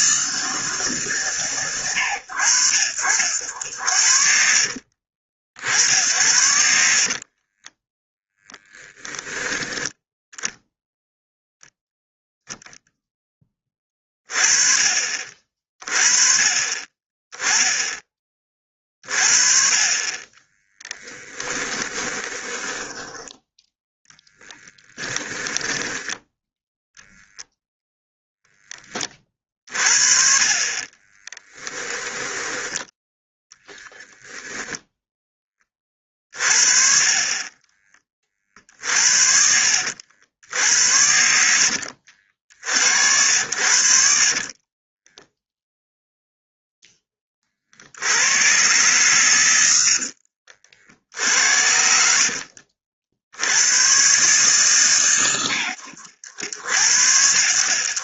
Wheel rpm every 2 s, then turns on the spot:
140, 80, 50, 50, 10, 0, 0, 30, 30, 30, 10, 10, 10, 10, 20, 30, 10, 0, 30, 60, 80, 70, 10, 10, 120, 60, 70, 130, 70.
4-8 20-26 44-46